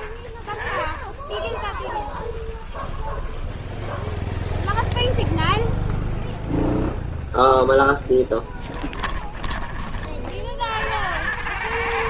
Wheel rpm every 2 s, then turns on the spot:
20, 0, 0, 0, 10, 60.
8-10